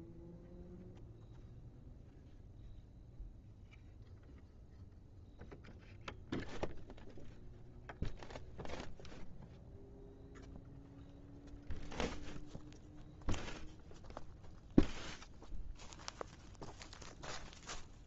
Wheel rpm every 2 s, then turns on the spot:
0, 0, 0, 0, 0, 0, 0, 0, 0.
none